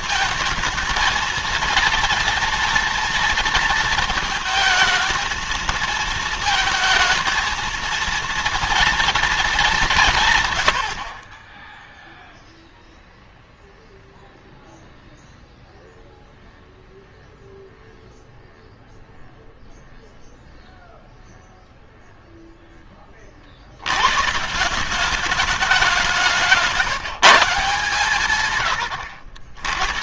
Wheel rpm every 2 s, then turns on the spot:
220, 230, 220, 220, 230, 90, 0, 0, 0, 0, 0, 10, 180, 170, 130.
none